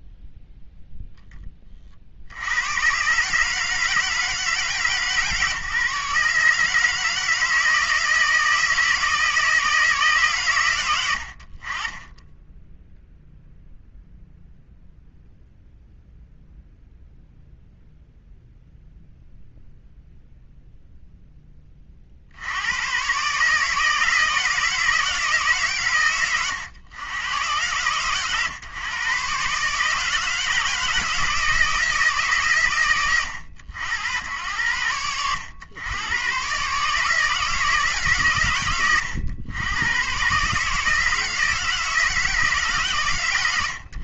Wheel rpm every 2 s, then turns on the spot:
0, 100, 150, 150, 160, 110, 10, 0, 0, 0, 0, 90, 160, 90, 120, 160, 100, 90, 140, 90, 150, 140.
none